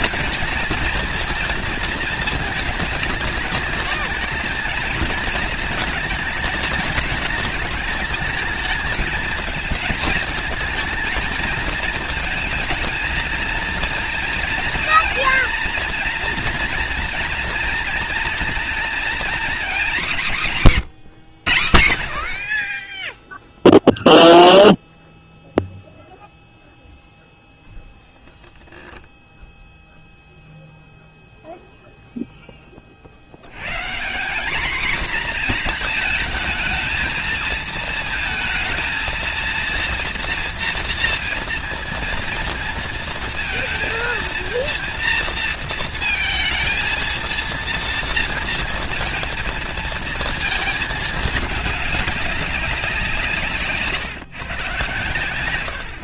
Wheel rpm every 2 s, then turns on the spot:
230, 220, 220, 210, 220, 220, 230, 230, 230, 230, 180, 60, 0, 0, 0, 0, 10, 210, 220, 230, 230, 230, 230, 230, 230, 220, 200, 130.
none